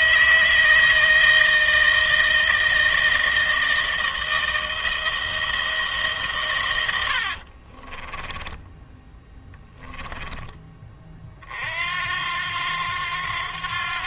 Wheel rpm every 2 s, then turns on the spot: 160, 160, 160, 120, 20, 20, 90.
6-10